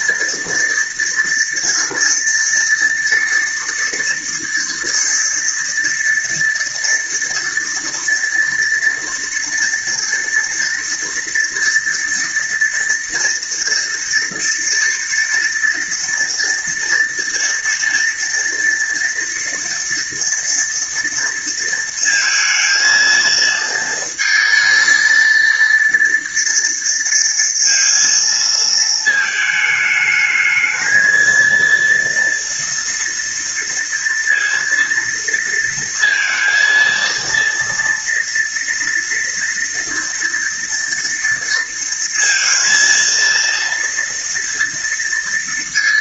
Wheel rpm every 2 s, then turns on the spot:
230, 230, 230, 230, 230, 230, 230, 230, 230, 230, 230, 220, 230, 230, 220, 220, 230, 230, 230, 230, 230, 230, 230.
none